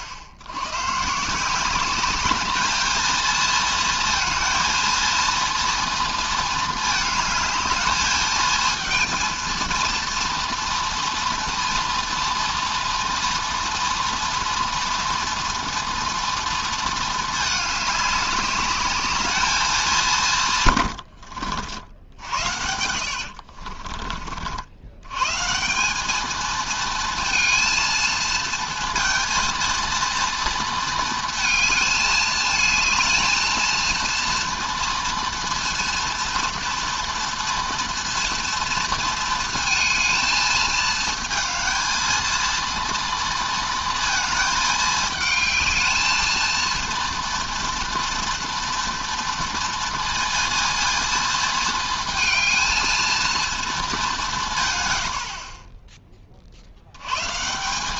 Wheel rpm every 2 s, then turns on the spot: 90, 220, 230, 220, 220, 230, 230, 230, 230, 200, 130, 70, 80, 220, 230, 230, 220, 230, 230, 230, 220, 230, 220, 230, 240, 230, 230, 150, 60.
22-24